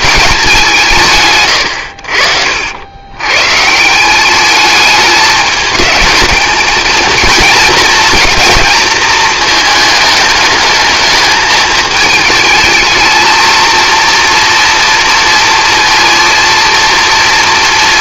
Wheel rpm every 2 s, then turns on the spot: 170, 80, 210, 220, 230, 220, 220, 230, 230.
none